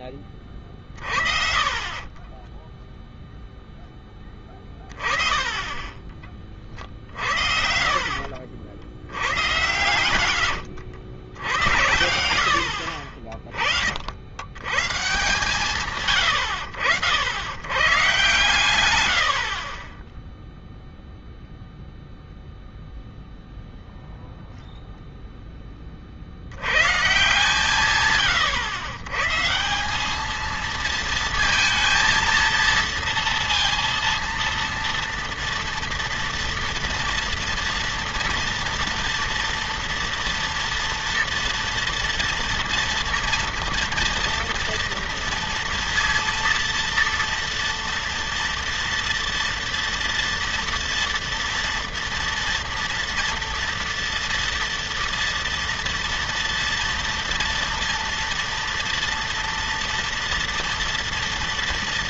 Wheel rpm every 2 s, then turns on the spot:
40, 10, 20, 70, 110, 80, 50, 160, 110, 40, 0, 0, 10, 140, 160, 230, 230, 230, 230, 230, 230, 230, 230, 230, 230, 230, 230, 230, 230, 230, 240.
0-2 4-10